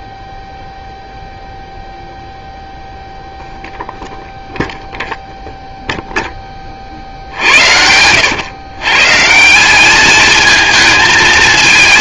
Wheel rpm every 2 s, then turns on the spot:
0, 0, 0, 40, 120, 220.
none